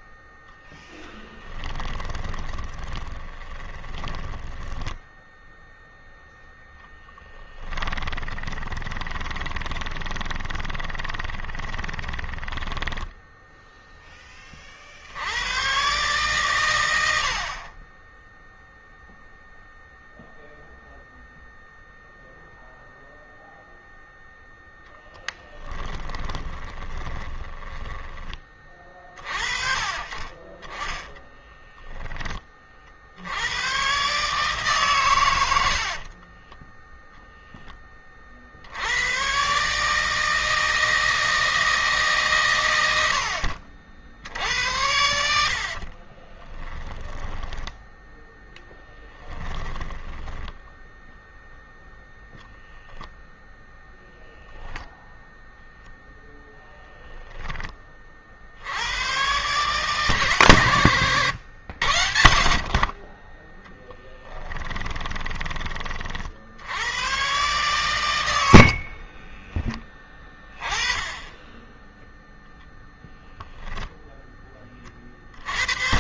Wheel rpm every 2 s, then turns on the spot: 10, 20, 10, 0, 20, 20, 10, 50, 90, 0, 0, 0, 10, 20, 30, 10, 40, 130, 10, 90, 160, 100, 80, 10, 10, 0, 0, 0, 10, 110, 110, 50, 10, 100, 40, 10, 0, 40.
0-6 8-14 26-28 30-32 44-50 64-66 68-70